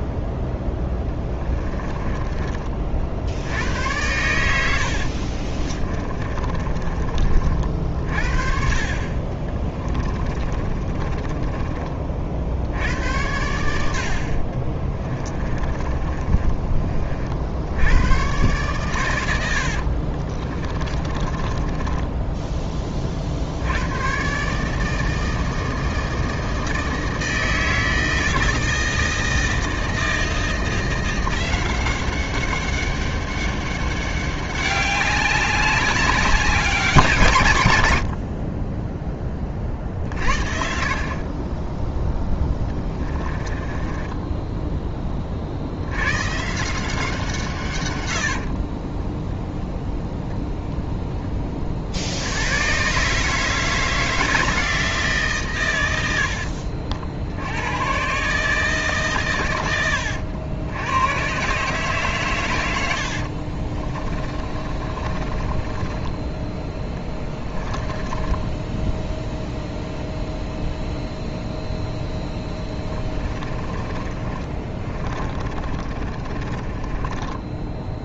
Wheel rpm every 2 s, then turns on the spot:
10, 30, 80, 30, 40, 20, 80, 30, 30, 120, 30, 10, 150, 160, 160, 170, 200, 200, 190, 20, 40, 20, 10, 160, 20, 10, 130, 160, 70, 150, 90, 80, 30, 10, 0, 0, 10, 20, 20.
0-2 4-8 10-12 14-16 20-22 42-44 62-66 72-78